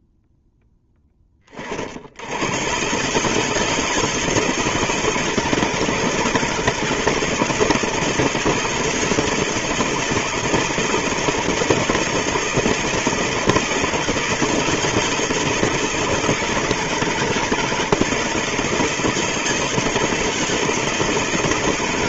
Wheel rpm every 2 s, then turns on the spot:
30, 160, 160, 160, 160, 160, 160, 160, 160, 160, 170.
none